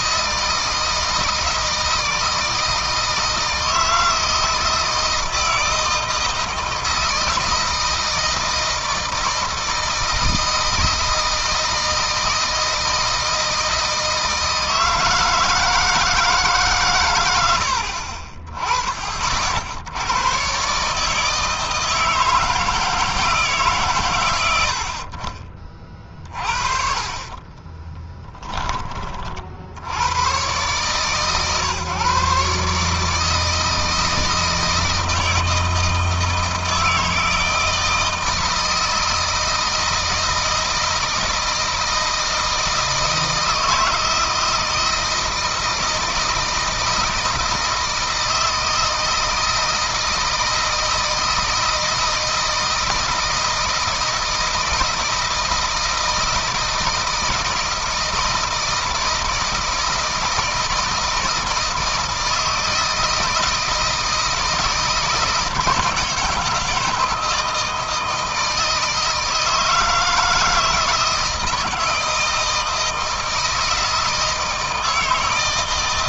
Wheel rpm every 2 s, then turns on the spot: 160, 160, 160, 160, 160, 160, 160, 160, 120, 30, 140, 160, 60, 40, 30, 140, 150, 160, 160, 160, 160, 160, 160, 160, 160, 160, 160, 160, 160, 160, 160, 160, 160, 160, 160, 160, 160, 160.
26-28